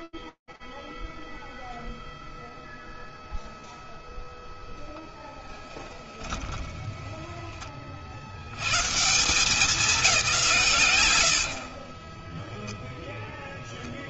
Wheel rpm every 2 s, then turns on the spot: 0, 0, 10, 30, 180, 70, 30.
4-6